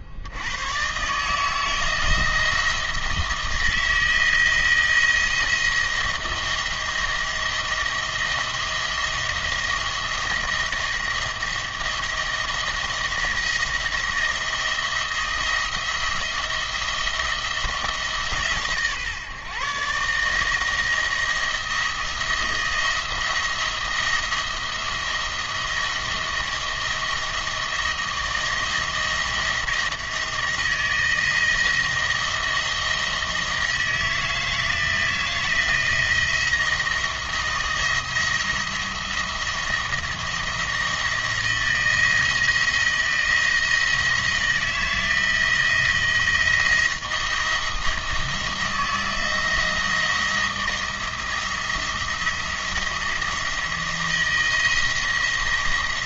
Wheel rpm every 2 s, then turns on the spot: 110, 170, 160, 170, 170, 170, 170, 160, 170, 150, 160, 170, 170, 170, 170, 170, 170, 160, 170, 170, 170, 170, 170, 170, 170, 170, 170, 170.
none